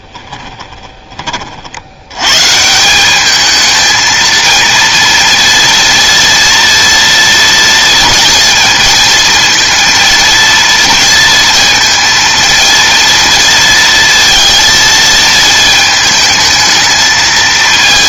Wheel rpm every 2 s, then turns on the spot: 20, 160, 230, 230, 230, 230, 230, 230, 220.
0-2